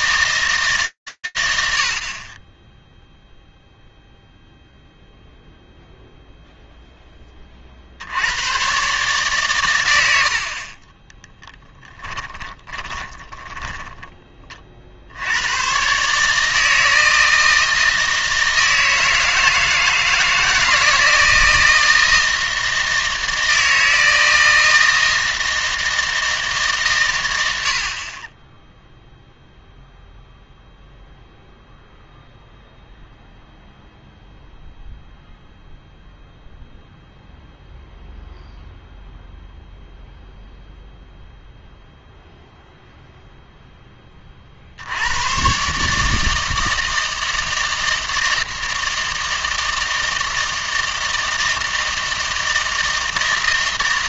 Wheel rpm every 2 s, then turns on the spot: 110, 0, 0, 0, 130, 30, 20, 70, 160, 160, 160, 160, 160, 140, 0, 0, 0, 0, 0, 0, 0, 0, 70, 160, 160, 160, 160.
10-14